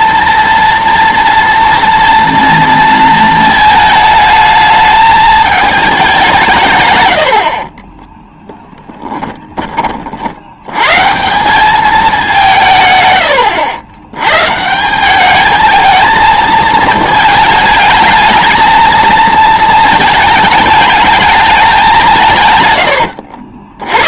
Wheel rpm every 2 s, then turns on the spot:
230, 230, 210, 140, 10, 110, 130, 160, 220, 220, 220, 110.
none